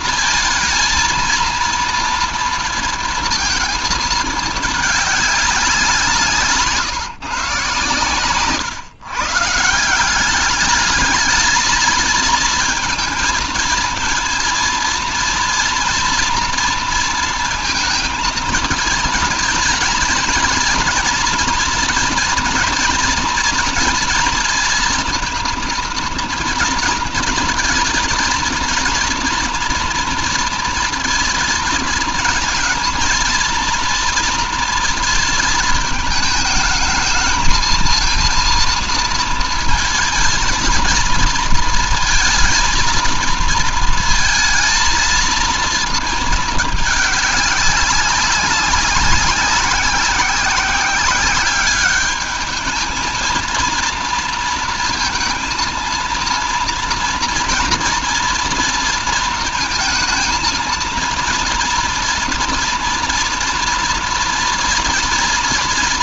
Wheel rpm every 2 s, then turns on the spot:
230, 230, 210, 150, 130, 220, 230, 240, 230, 230, 230, 240, 230, 230, 240, 230, 230, 230, 220, 230, 230, 230, 230, 200, 190, 190, 220, 230, 230, 230, 230, 230, 230.
none